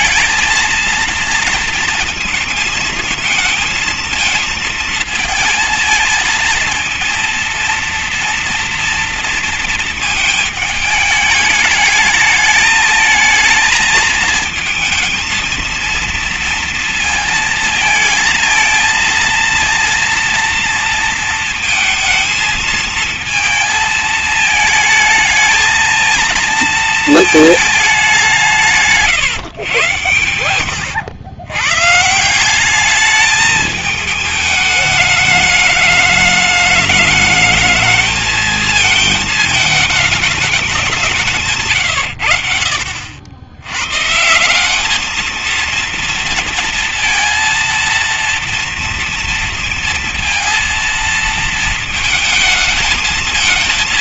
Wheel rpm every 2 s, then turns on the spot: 220, 230, 220, 220, 230, 220, 220, 230, 230, 230, 230, 230, 220, 230, 170, 100, 180, 210, 210, 220, 200, 60, 180, 230, 230, 230, 220.
30-32